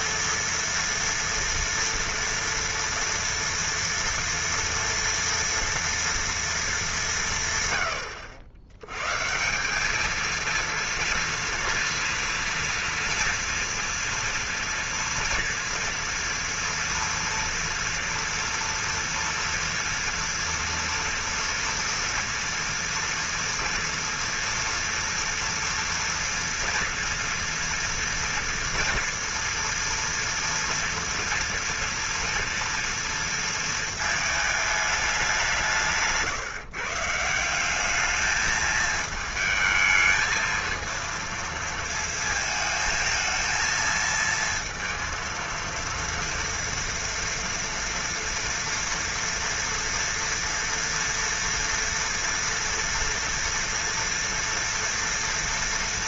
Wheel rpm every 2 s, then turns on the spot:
230, 230, 230, 210, 90, 230, 230, 230, 240, 230, 230, 230, 230, 230, 230, 230, 230, 220, 150, 210, 220, 220, 230, 230, 230, 230, 230, 230.
none